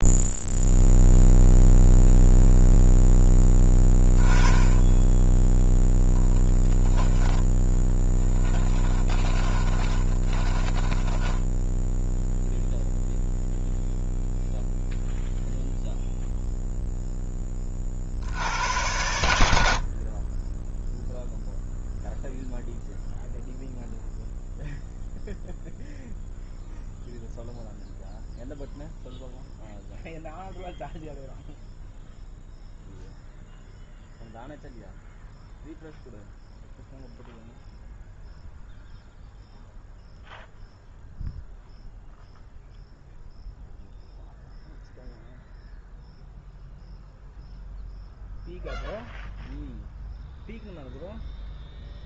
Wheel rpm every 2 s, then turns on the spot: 0, 0, 10, 0, 10, 20, 0, 0, 0, 90, 10, 0, 0, 0, 0, 0, 0, 0, 0, 0, 0, 0, 0, 0, 0, 0.
8-12